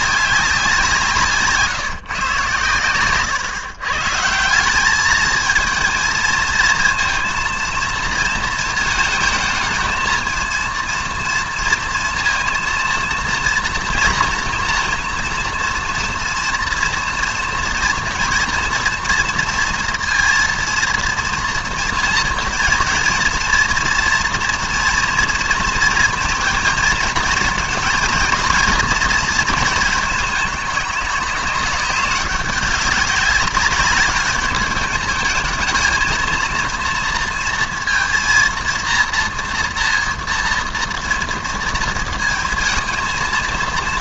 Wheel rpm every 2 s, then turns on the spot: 180, 130, 180, 230, 230, 230, 230, 230, 230, 230, 230, 230, 240, 230, 230, 210, 200, 210, 230, 230, 230, 230.
none